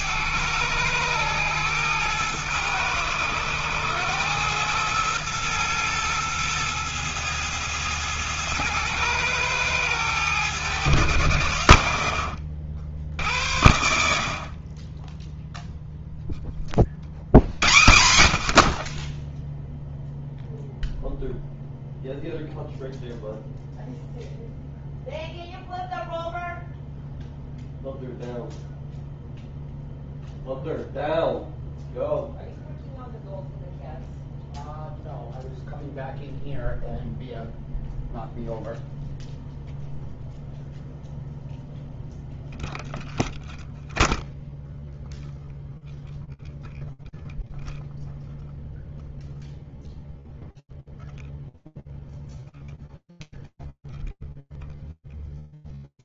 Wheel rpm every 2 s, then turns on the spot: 100, 110, 110, 110, 110, 110, 60, 40, 20, 60, 0, 0, 0, 0, 0, 0, 0, 0, 0, 0, 0, 0, 0, 0, 0, 0, 0, 0.
none